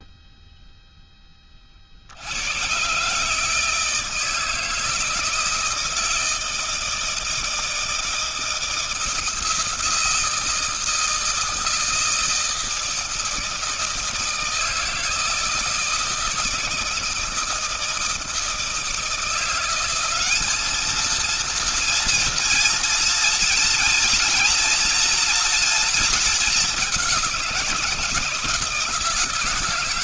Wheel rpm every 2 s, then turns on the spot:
0, 90, 160, 160, 160, 160, 160, 160, 170, 160, 200, 230, 240, 210, 160.
none